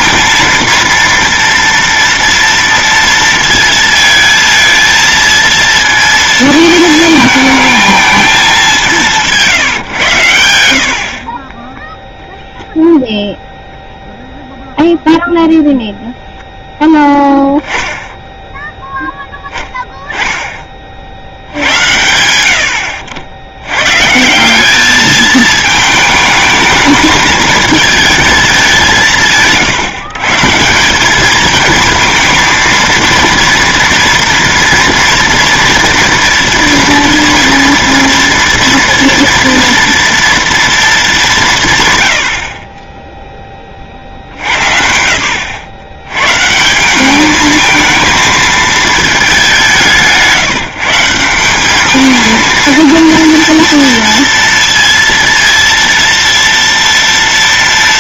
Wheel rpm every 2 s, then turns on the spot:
230, 230, 230, 220, 190, 80, 0, 0, 0, 0, 30, 70, 200, 220, 200, 170, 230, 230, 230, 230, 230, 30, 100, 180, 220, 150, 230, 230, 230.
10-12